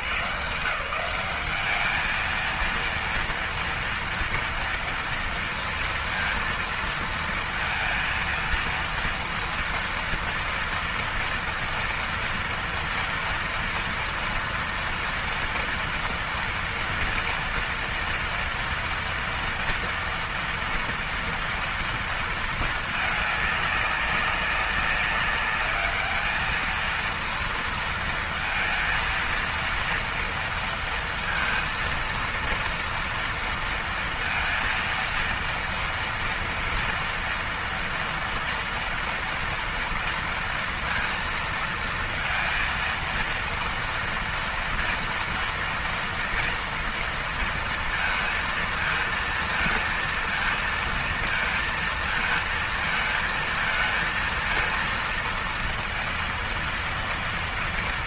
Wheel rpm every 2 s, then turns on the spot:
100, 220, 230, 230, 230, 230, 230, 230, 230, 230, 230, 230, 200, 210, 230, 230, 230, 230, 230, 240, 230, 230, 230, 230, 230, 230, 230, 230, 230.
none